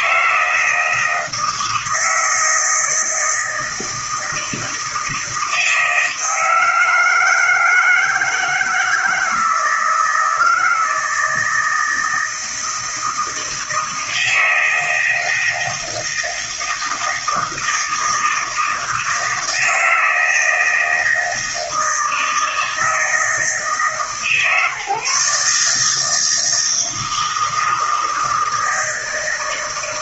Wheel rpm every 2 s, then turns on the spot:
160, 160, 160, 160, 160, 160, 160, 160, 160, 160, 160, 160, 150, 160, 160.
none